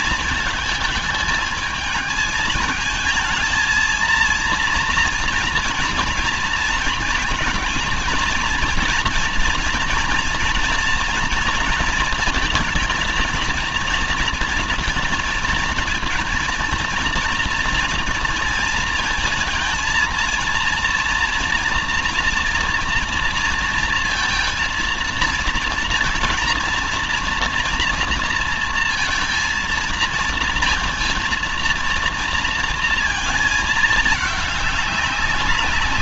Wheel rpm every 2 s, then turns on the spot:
220, 220, 230, 220, 230, 240, 230, 230, 230, 230, 230, 230, 230, 230, 230, 230, 230, 200.
none